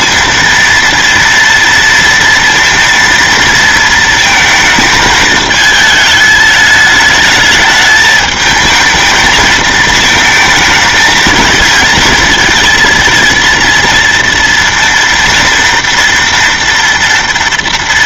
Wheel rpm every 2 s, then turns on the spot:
230, 230, 220, 210, 220, 220, 230, 230, 230.
none